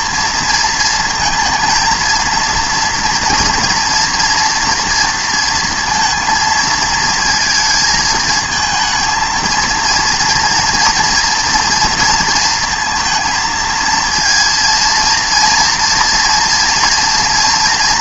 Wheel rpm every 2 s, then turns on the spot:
230, 230, 240, 230, 220, 230, 230, 230, 230.
none